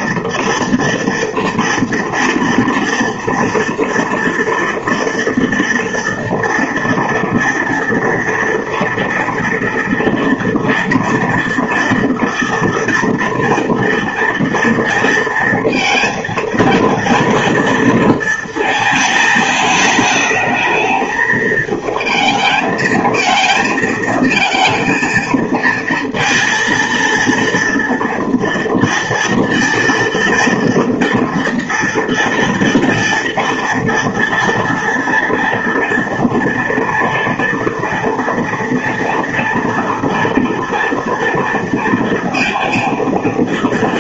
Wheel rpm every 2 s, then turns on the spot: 230, 230, 230, 230, 240, 230, 230, 230, 220, 220, 220, 220, 230, 230, 230, 230, 230, 230, 230, 230, 240, 230.
none